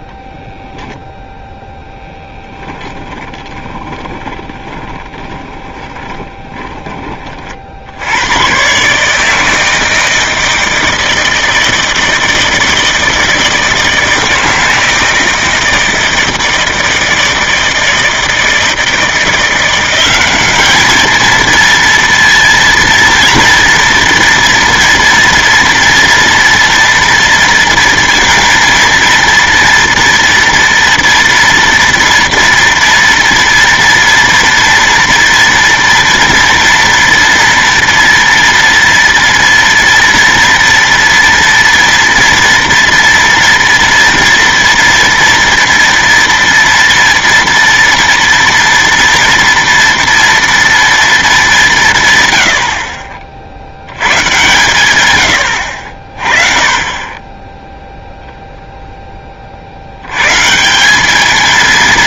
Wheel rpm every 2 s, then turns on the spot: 0, 10, 20, 20, 120, 160, 160, 160, 160, 160, 210, 230, 230, 230, 230, 230, 230, 230, 230, 230, 230, 240, 230, 230, 230, 230, 80, 120, 30, 0, 170.
2-8